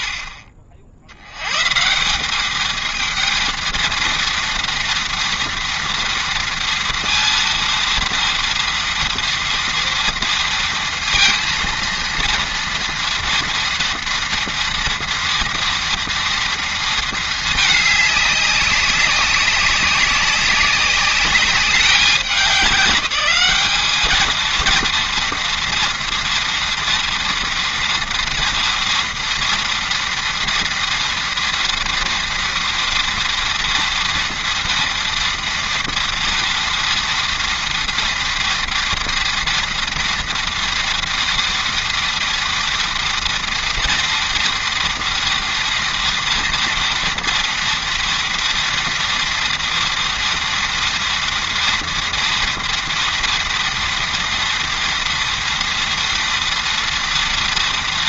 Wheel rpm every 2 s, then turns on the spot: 70, 230, 230, 230, 230, 230, 230, 230, 220, 190, 200, 200, 240, 230, 230, 230, 230, 230, 230, 230, 230, 240, 240, 230, 230, 230, 230, 230, 230.
none